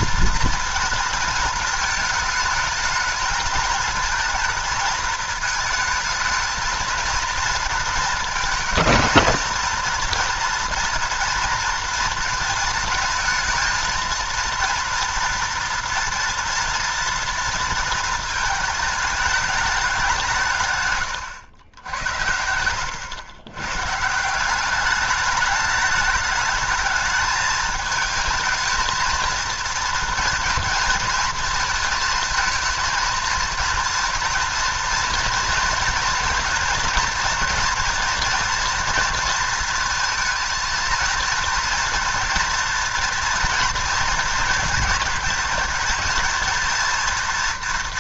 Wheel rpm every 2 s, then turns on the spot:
240, 220, 220, 220, 230, 230, 230, 230, 230, 220, 130, 90, 190, 210, 220, 230, 230, 230, 230, 230, 220, 230, 230, 230.
none